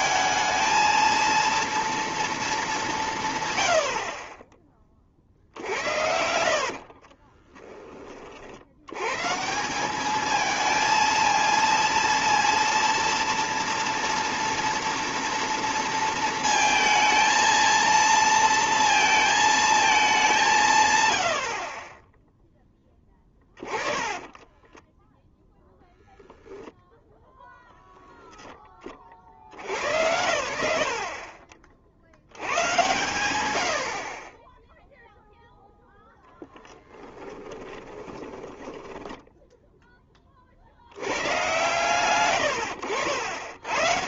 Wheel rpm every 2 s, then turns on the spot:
220, 220, 30, 60, 80, 220, 230, 240, 220, 230, 150, 10, 10, 0, 40, 60, 110, 0, 10, 10, 80, 80.
6-8 24-26 36-40 42-44